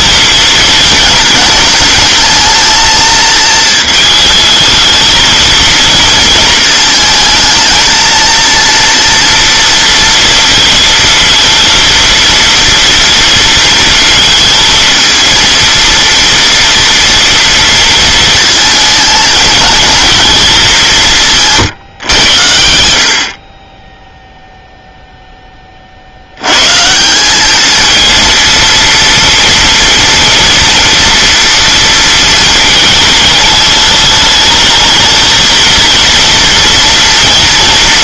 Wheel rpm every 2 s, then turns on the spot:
230, 220, 220, 220, 230, 230, 230, 220, 230, 230, 200, 80, 0, 110, 230, 230, 220, 220, 230.
none